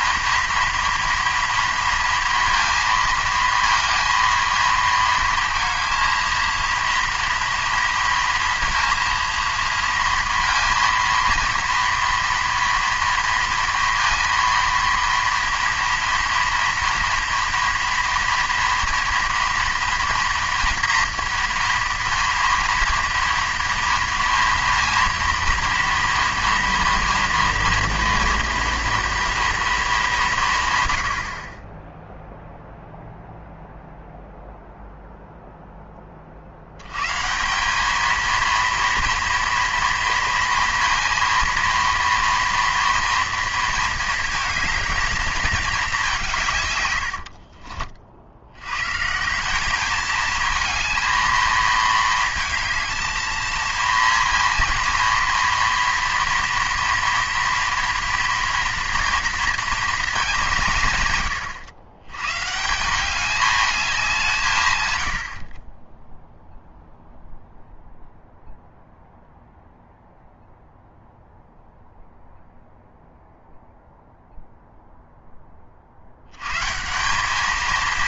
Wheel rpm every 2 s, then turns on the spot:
230, 230, 230, 230, 230, 230, 230, 230, 240, 240, 240, 230, 230, 240, 230, 140, 0, 0, 70, 230, 230, 230, 220, 110, 130, 220, 220, 230, 230, 240, 170, 170, 110, 0, 0, 0, 0, 0, 160.
46-48